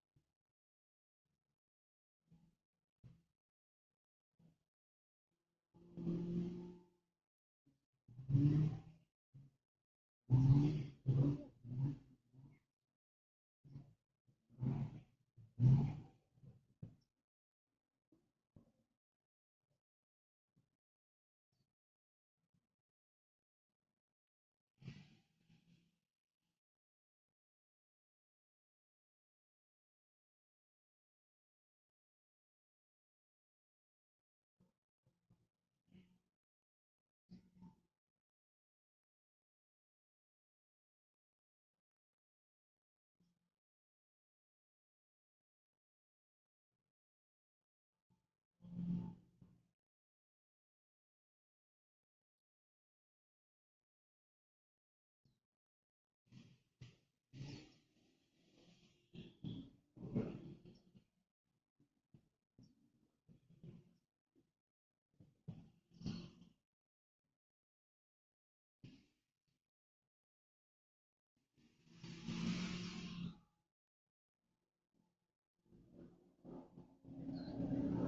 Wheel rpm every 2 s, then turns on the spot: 0, 0, 0, 0, 0, 0, 0, 0, 0, 0, 0, 0, 0, 0, 0, 0, 0, 0, 0, 0, 0, 0, 0, 0, 0, 0, 0, 0, 0, 0, 0, 0, 0, 0, 0, 0, 0, 0, 0.
none